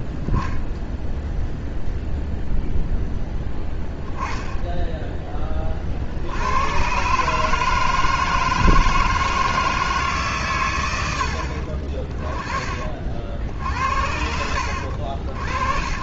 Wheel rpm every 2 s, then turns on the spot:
0, 0, 10, 100, 160, 120, 50, 80.
none